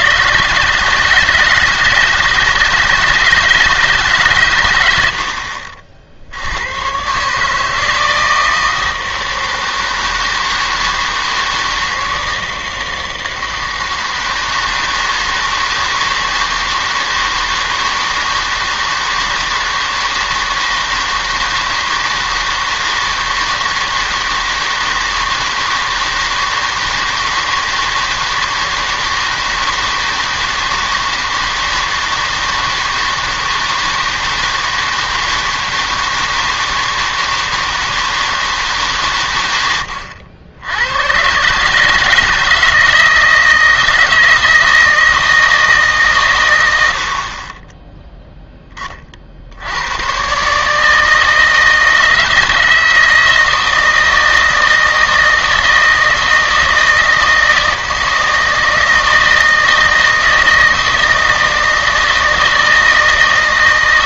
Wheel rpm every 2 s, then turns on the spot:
150, 160, 110, 100, 160, 160, 160, 160, 160, 160, 160, 160, 160, 160, 160, 160, 160, 160, 160, 150, 90, 160, 160, 110, 10, 150, 160, 160, 160, 160, 160, 160.
none